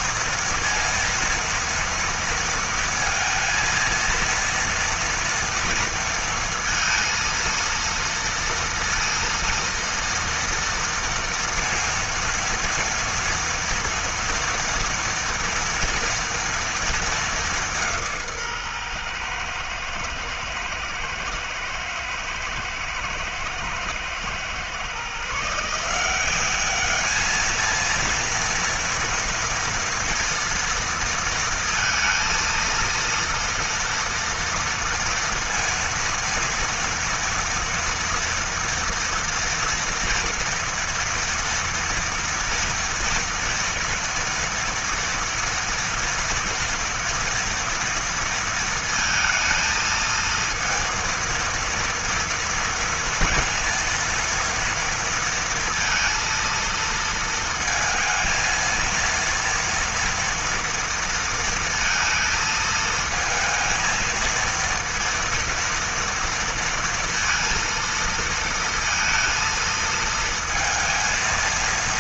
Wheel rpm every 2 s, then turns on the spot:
230, 230, 230, 230, 230, 230, 230, 230, 210, 120, 110, 110, 140, 210, 230, 230, 230, 230, 230, 240, 240, 230, 230, 230, 230, 230, 230, 230, 230, 230, 230, 220, 230, 230, 230, 230.
none